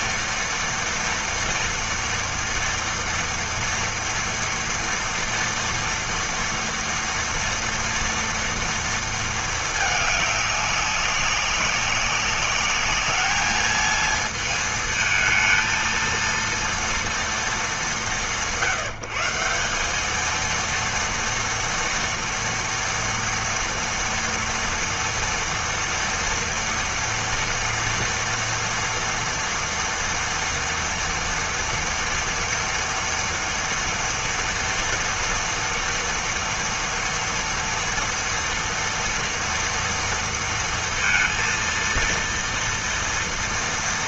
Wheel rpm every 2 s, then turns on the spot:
230, 230, 240, 230, 230, 200, 200, 220, 230, 150, 230, 230, 230, 230, 240, 230, 230, 230, 230, 230, 230, 230.
none